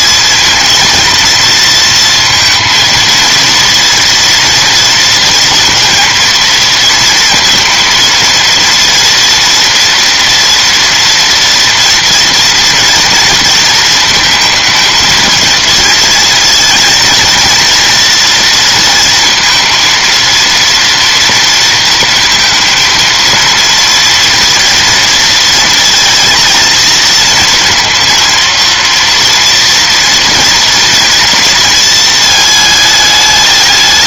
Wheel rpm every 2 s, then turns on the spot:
220, 230, 230, 230, 230, 230, 230, 230, 230, 230, 230, 230, 230, 230, 230, 230, 220.
none